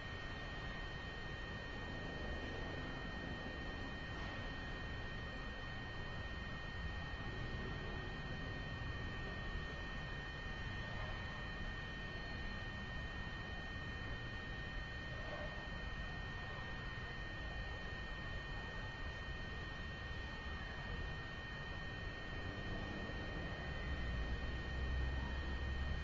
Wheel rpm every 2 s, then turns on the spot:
0, 0, 0, 0, 0, 0, 0, 0, 0, 0, 0, 0, 0.
none